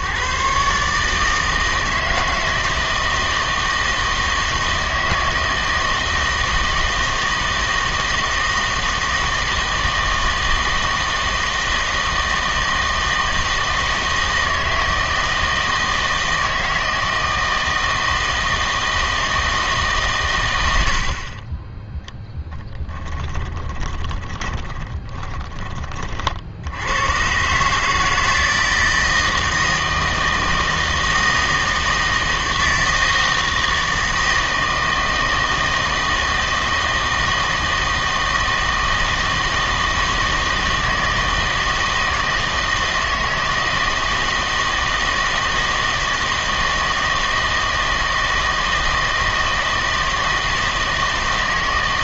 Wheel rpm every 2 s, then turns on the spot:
140, 160, 160, 160, 160, 160, 160, 160, 160, 160, 100, 10, 20, 70, 160, 160, 160, 160, 160, 160, 160, 160, 160, 170, 160, 160.
22-26